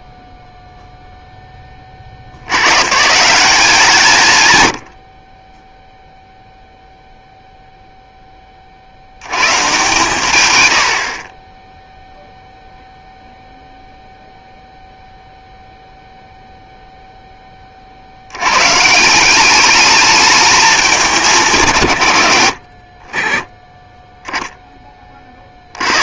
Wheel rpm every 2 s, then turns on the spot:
0, 120, 80, 0, 40, 90, 0, 0, 0, 140, 210, 40, 10.
none